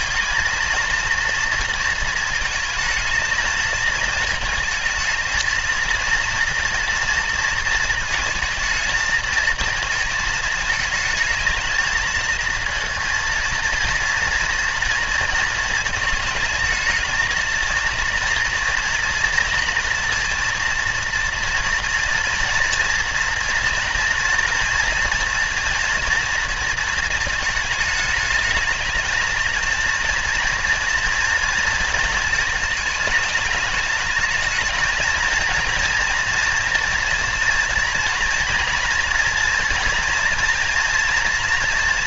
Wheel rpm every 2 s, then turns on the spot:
230, 220, 220, 230, 220, 220, 230, 230, 220, 230, 230, 230, 230, 230, 220, 230, 220, 220, 240, 230, 230.
none